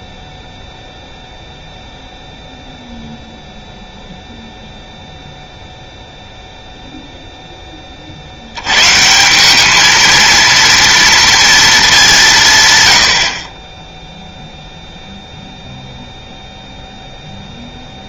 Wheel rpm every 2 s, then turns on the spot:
0, 0, 0, 0, 100, 230, 130, 0, 0.
none